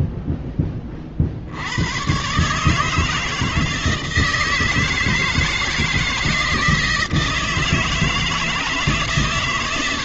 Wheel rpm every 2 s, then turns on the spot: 10, 140, 160, 170, 160.
none